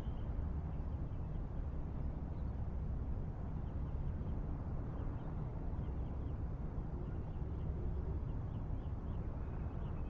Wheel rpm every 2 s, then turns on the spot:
0, 0, 0, 0, 0.
none